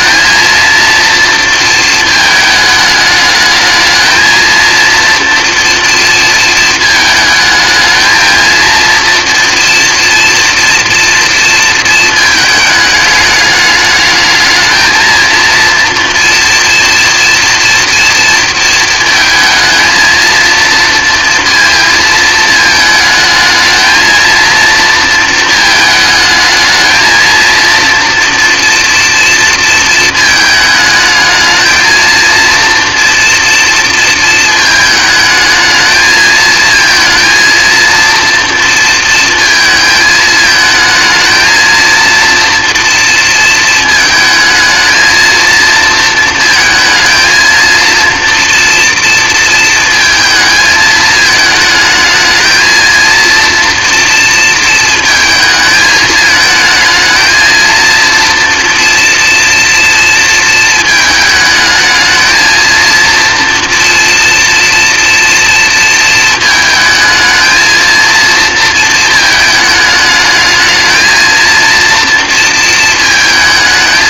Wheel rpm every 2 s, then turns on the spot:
230, 220, 230, 230, 230, 230, 220, 220, 230, 230, 230, 220, 230, 220, 230, 220, 230, 220, 220, 230, 220, 230, 220, 230, 230, 220, 220, 230, 220, 230, 220, 230, 230, 220, 230, 220, 230.
none